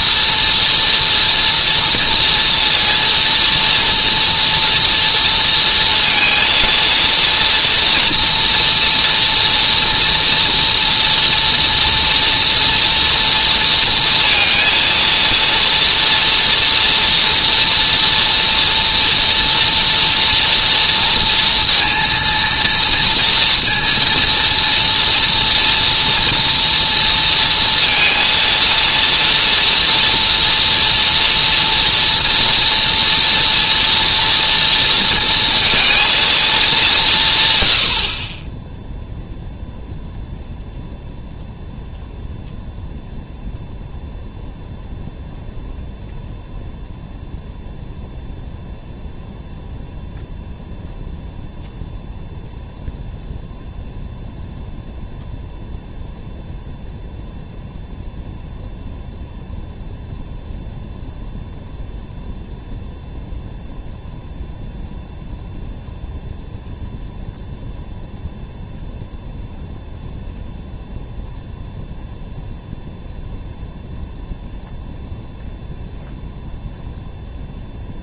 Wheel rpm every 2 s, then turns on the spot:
230, 230, 240, 240, 230, 240, 240, 230, 240, 230, 240, 230, 230, 240, 230, 230, 230, 230, 200, 10, 0, 0, 0, 0, 0, 0, 0, 0, 0, 0, 0, 0, 0, 0, 0, 0, 0, 0, 0.
none